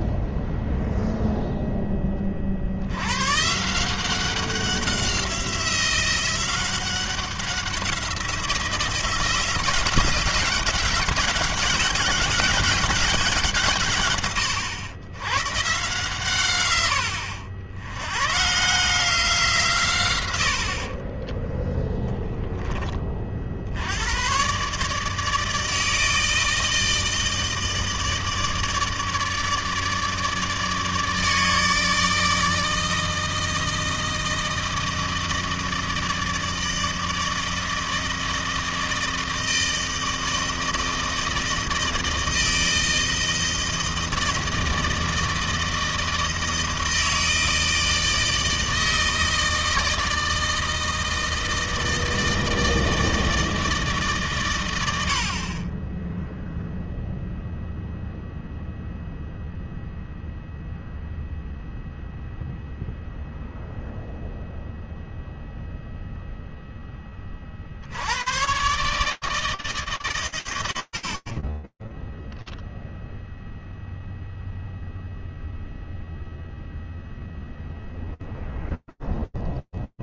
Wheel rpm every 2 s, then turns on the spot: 0, 100, 180, 190, 170, 180, 190, 110, 100, 150, 40, 20, 150, 160, 160, 160, 160, 160, 160, 160, 160, 160, 160, 160, 160, 160, 160, 120, 0, 0, 0, 0, 0, 0, 110, 110, 0, 0, 0, 0.
none